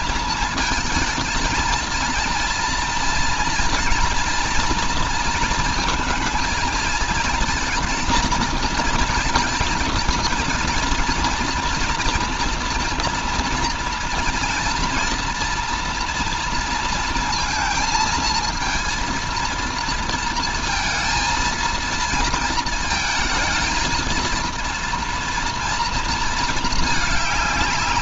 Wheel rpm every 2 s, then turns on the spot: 230, 230, 230, 230, 230, 230, 230, 230, 230, 230, 230, 220, 230, 220.
none